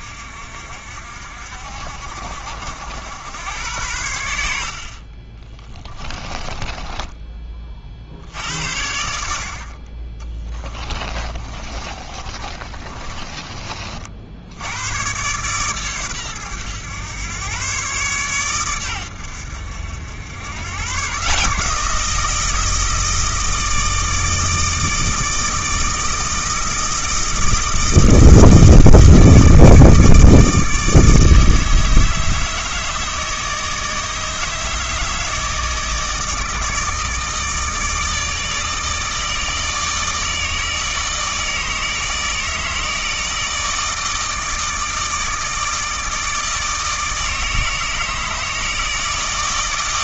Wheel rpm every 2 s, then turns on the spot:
60, 70, 50, 10, 80, 30, 30, 100, 110, 110, 130, 160, 160, 160, 160, 160, 160, 160, 160, 160, 150, 160, 160, 160, 160.
6-8 10-14